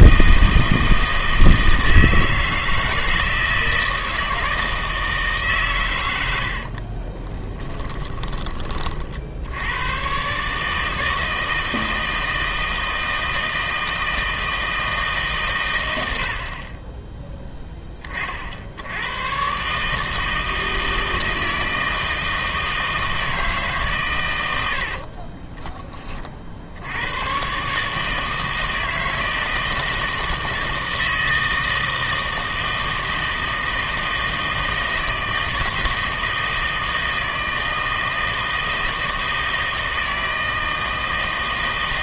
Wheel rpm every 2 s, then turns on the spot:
160, 160, 160, 70, 30, 150, 160, 160, 30, 70, 160, 160, 80, 70, 160, 160, 160, 160, 160, 160, 160.
6-8 24-26